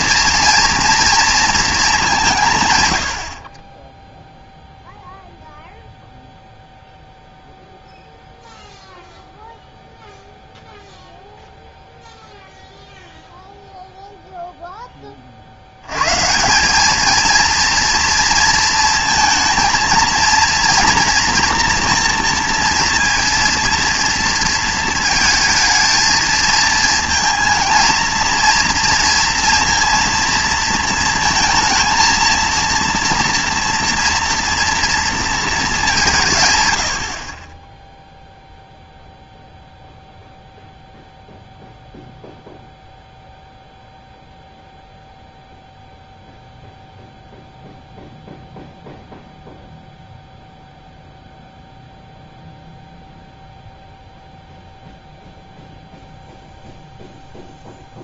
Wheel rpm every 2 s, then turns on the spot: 240, 120, 0, 0, 0, 0, 0, 0, 180, 230, 230, 230, 230, 220, 230, 230, 230, 230, 120, 0, 0, 0, 0, 0, 0, 0, 0, 0, 0.
none